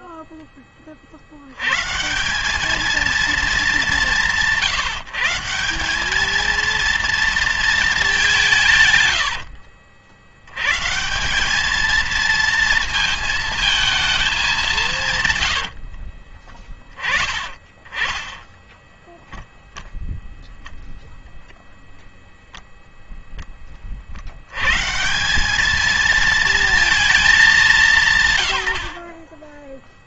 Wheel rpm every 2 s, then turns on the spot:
20, 200, 170, 230, 150, 110, 220, 200, 40, 10, 0, 0, 110, 230, 110.
18-20